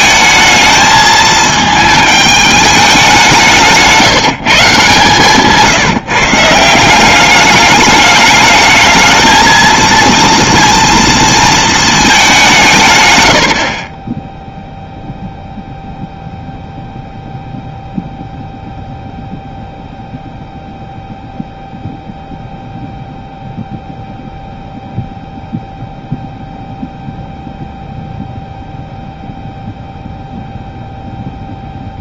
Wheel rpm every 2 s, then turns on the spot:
220, 210, 160, 160, 210, 230, 160, 0, 0, 0, 0, 0, 0, 0, 0, 0.
none